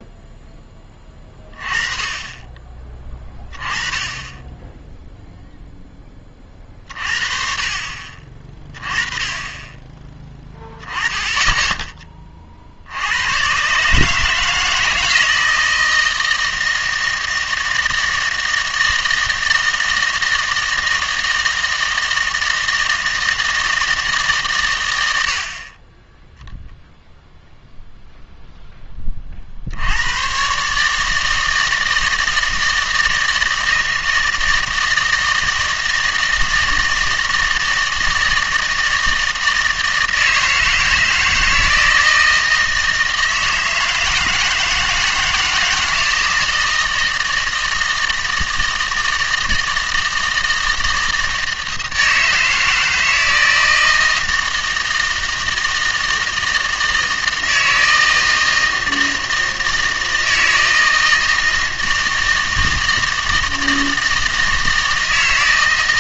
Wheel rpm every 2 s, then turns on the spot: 10, 20, 10, 40, 30, 10, 50, 160, 160, 160, 160, 160, 110, 0, 10, 140, 160, 160, 160, 160, 160, 160, 160, 160, 160, 160, 160, 160, 160, 160, 160, 160, 160.
none